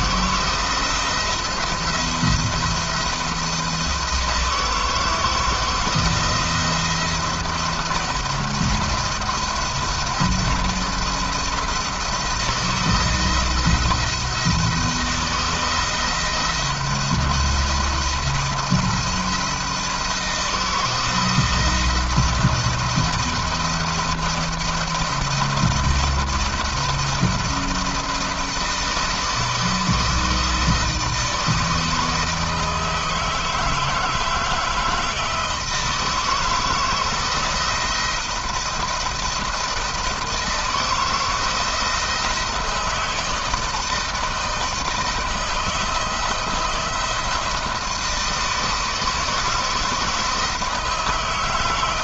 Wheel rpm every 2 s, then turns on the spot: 170, 170, 160, 170, 170, 170, 170, 160, 170, 170, 160, 170, 170, 170, 160, 160, 160, 160, 160, 160, 160, 160, 160, 170, 170, 160.
none